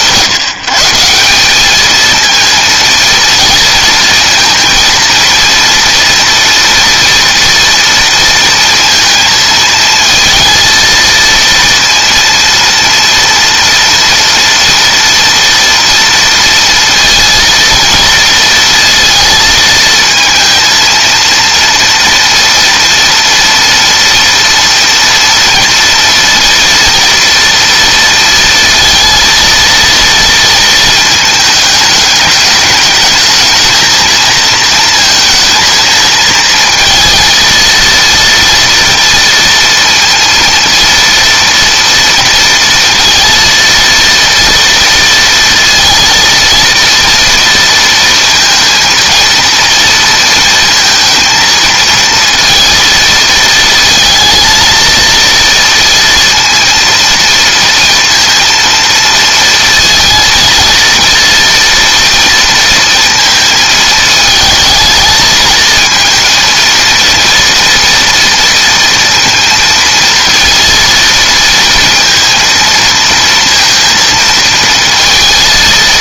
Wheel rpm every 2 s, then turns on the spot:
170, 220, 230, 230, 230, 230, 230, 230, 230, 230, 230, 230, 230, 230, 230, 230, 210, 230, 220, 230, 230, 230, 230, 230, 230, 230, 230, 220, 230, 230, 230, 230, 220, 230, 230, 230, 230, 230.
none